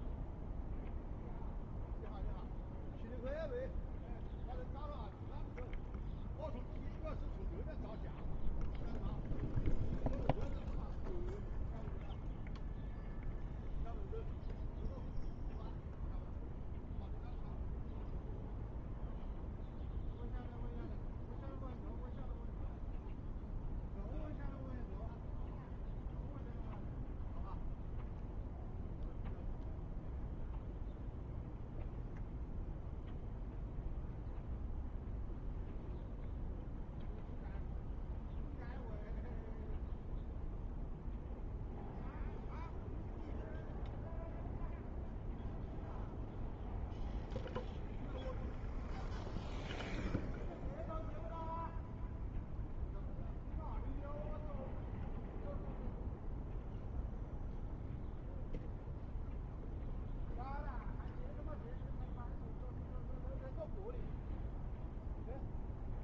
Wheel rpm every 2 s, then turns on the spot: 0, 0, 0, 0, 0, 0, 0, 0, 0, 0, 0, 0, 0, 0, 0, 0, 0, 0, 0, 0, 0, 0, 0, 0, 0, 0, 0, 0, 0, 0, 0, 0, 0.
none